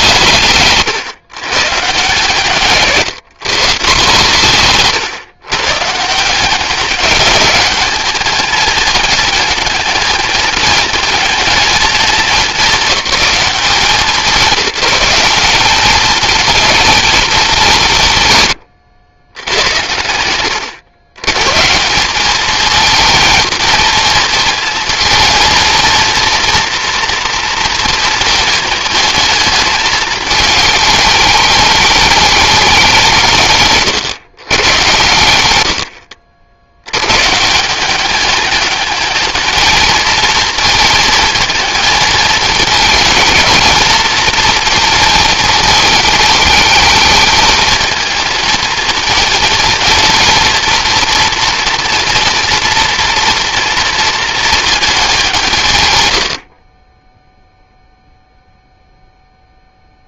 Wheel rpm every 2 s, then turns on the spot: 140, 150, 150, 180, 210, 220, 210, 170, 220, 130, 100, 220, 230, 230, 220, 220, 210, 120, 80, 210, 220, 220, 230, 220, 220, 230, 230, 220, 50, 0.
none